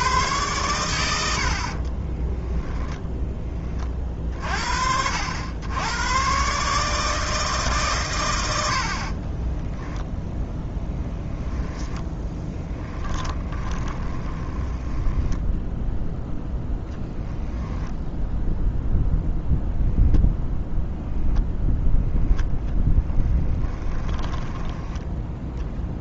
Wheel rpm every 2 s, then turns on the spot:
110, 10, 50, 140, 80, 0, 10, 10, 0, 0, 0, 0, 10.
2-4 12-16